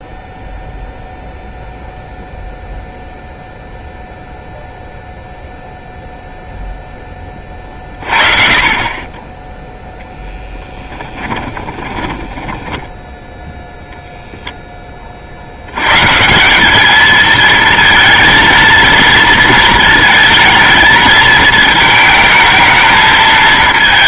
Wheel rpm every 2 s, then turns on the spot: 0, 0, 0, 0, 30, 10, 10, 10, 180, 230, 220, 220.
10-14